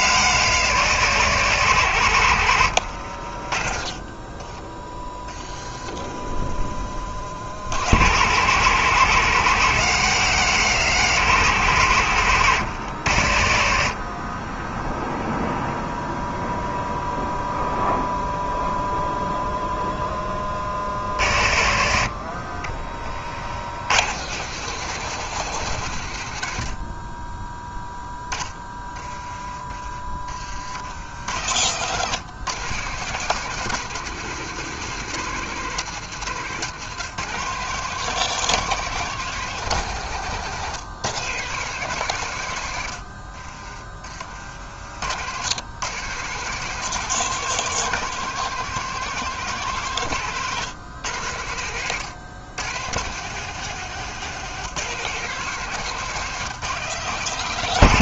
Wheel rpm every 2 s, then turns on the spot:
120, 90, 20, 40, 120, 120, 90, 10, 0, 0, 30, 20, 150, 70, 20, 60, 130, 150, 130, 160, 140, 90, 50, 150, 160, 120, 110, 150, 140.
2-6 22-24